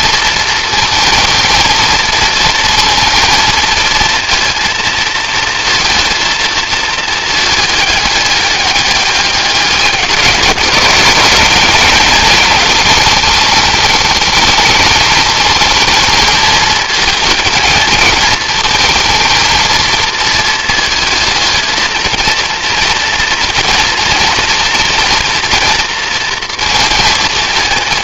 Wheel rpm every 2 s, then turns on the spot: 220, 230, 230, 220, 200, 190, 210, 210, 220, 220, 220, 230, 230, 230.
none